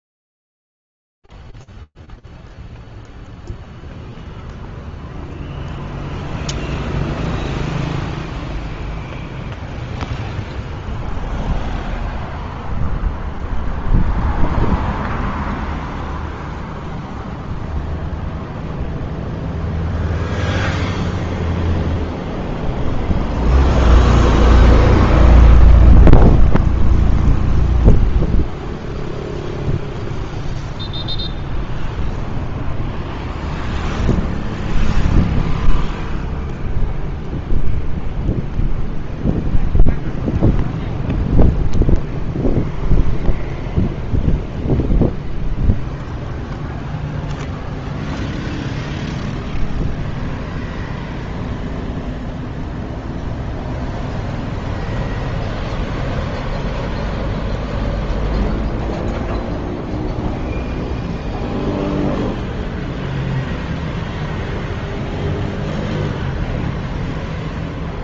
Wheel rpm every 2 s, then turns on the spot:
0, 0, 0, 0, 0, 0, 0, 0, 0, 0, 0, 0, 0, 0, 0, 0, 0, 0, 0, 0, 0, 0, 0, 0, 0, 0, 0, 0, 0, 0, 0, 0, 0, 0.
none